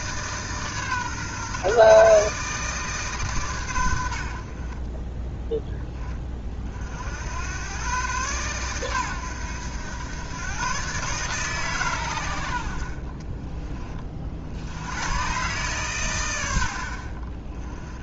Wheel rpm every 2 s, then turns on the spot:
140, 150, 40, 50, 120, 130, 60, 90, 50.
none